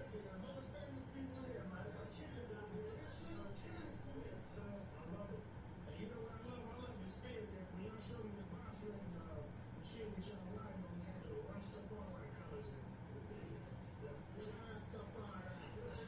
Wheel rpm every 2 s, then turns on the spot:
0, 0, 0, 0, 0, 0, 0, 0.
none